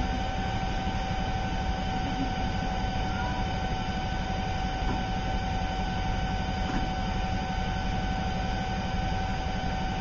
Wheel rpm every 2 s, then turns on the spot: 0, 0, 0, 0, 0.
none